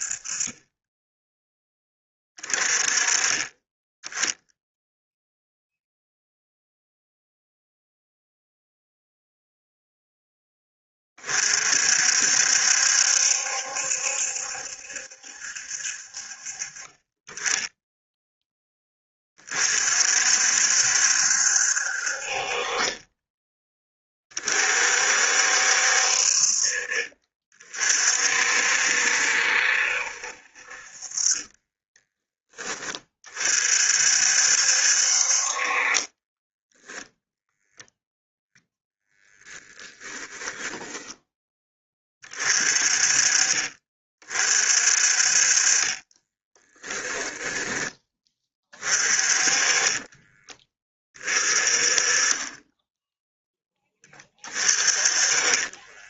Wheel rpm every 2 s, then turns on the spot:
20, 20, 0, 0, 0, 30, 70, 70, 30, 30, 70, 30, 60, 40, 70, 40, 20, 60, 10, 10, 10, 30, 40, 10, 30, 20, 10, 30.
46-48 54-56